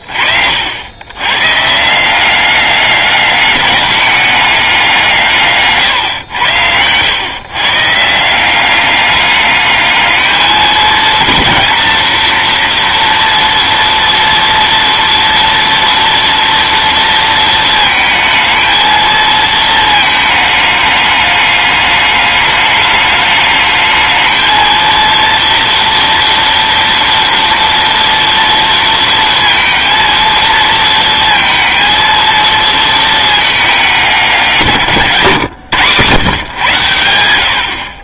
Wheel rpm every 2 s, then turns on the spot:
100, 200, 180, 110, 200, 220, 230, 230, 230, 220, 210, 210, 230, 230, 230, 230, 220, 140, 100.
none